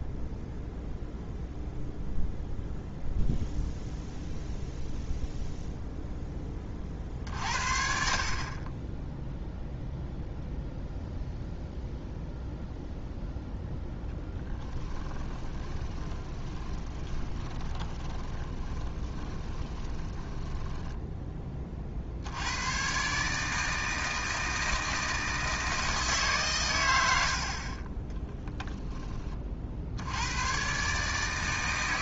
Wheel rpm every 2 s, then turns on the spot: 0, 0, 0, 40, 20, 0, 0, 10, 20, 20, 10, 130, 160, 120, 20, 140.
14-22